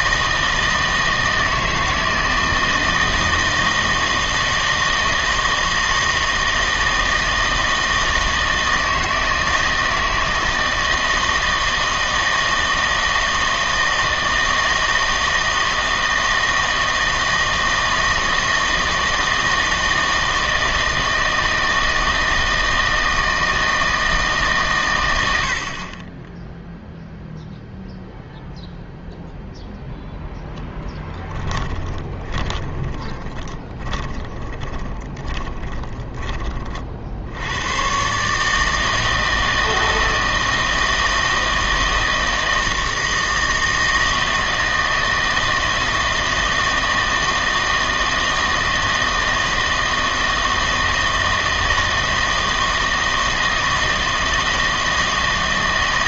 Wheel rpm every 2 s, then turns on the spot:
160, 160, 160, 160, 160, 160, 160, 160, 160, 160, 160, 160, 140, 0, 0, 10, 20, 30, 40, 160, 160, 160, 160, 160, 160, 160, 160, 160.
30-36